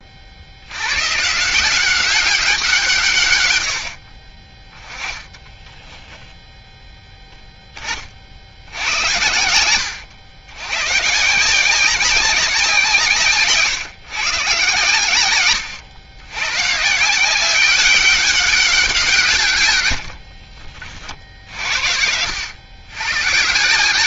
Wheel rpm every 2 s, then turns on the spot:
90, 170, 20, 0, 70, 110, 170, 130, 140, 190, 50, 100.
4-6